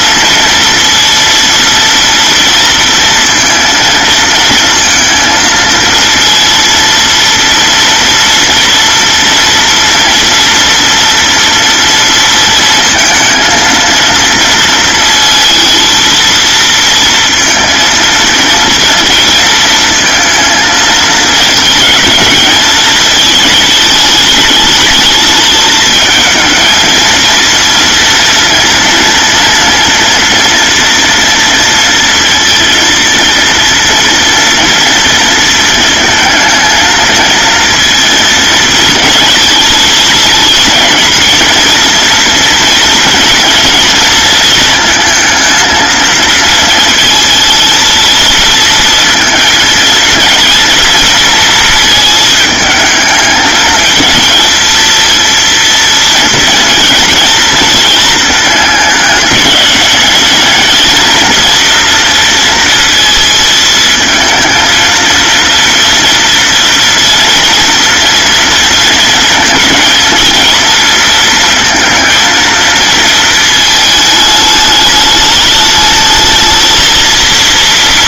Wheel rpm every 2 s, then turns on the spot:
230, 230, 230, 230, 230, 230, 230, 230, 230, 230, 220, 220, 210, 220, 230, 240, 230, 230, 230, 220, 230, 230, 230, 220, 230, 230, 220, 220, 230, 210, 220, 230, 230, 230, 230, 230, 230, 210, 230.
none